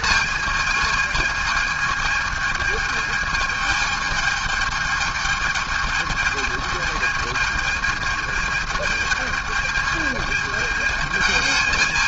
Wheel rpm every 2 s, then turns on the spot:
220, 220, 220, 220, 220, 210.
none